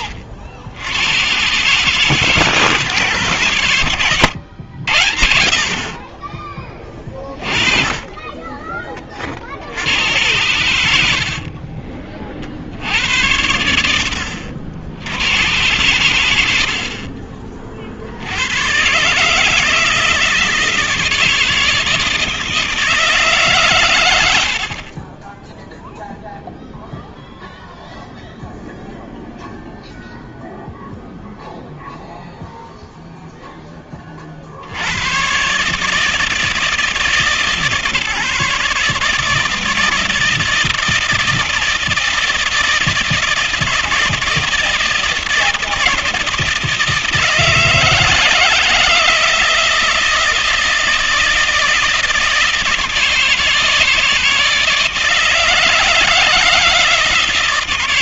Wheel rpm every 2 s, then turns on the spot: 80, 150, 90, 20, 20, 100, 60, 60, 60, 120, 160, 160, 60, 0, 0, 0, 0, 60, 150, 140, 160, 160, 160, 160, 160, 160, 160, 160, 160.
16-18